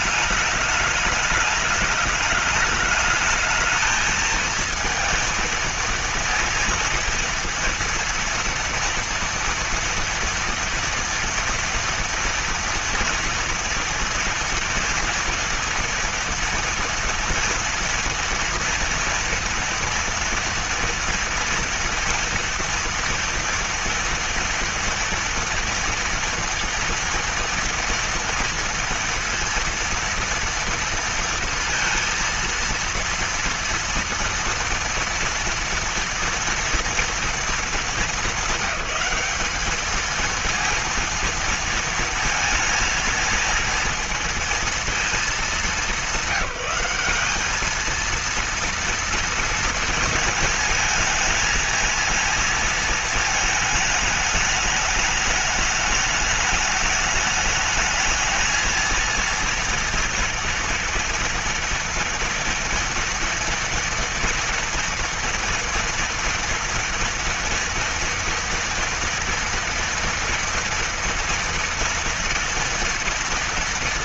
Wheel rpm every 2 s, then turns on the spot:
210, 210, 230, 230, 230, 230, 230, 230, 230, 230, 230, 240, 230, 230, 230, 230, 230, 230, 230, 210, 230, 230, 230, 190, 230, 230, 230, 220, 210, 220, 230, 240, 230, 230, 230, 230, 230.
none